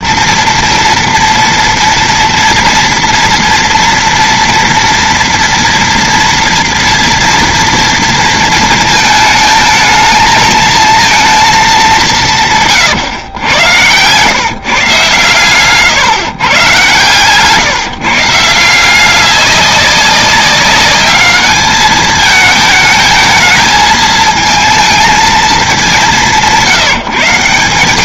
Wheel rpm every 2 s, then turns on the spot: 230, 230, 240, 230, 230, 220, 160, 130, 130, 160, 200, 220, 220, 180.
none